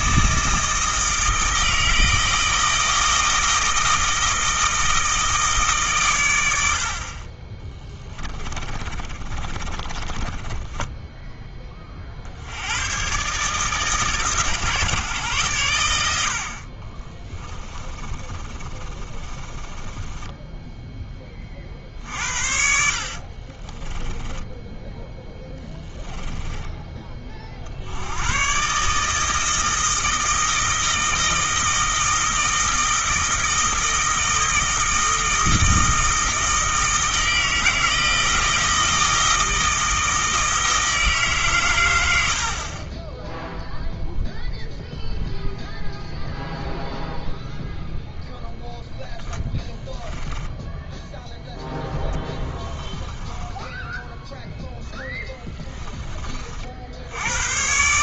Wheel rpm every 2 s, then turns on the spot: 160, 160, 160, 60, 30, 10, 100, 140, 30, 30, 10, 50, 10, 20, 140, 160, 160, 160, 160, 160, 160, 30, 0, 0, 0, 0, 10, 10, 70.
8-12 16-20 22-26 52-54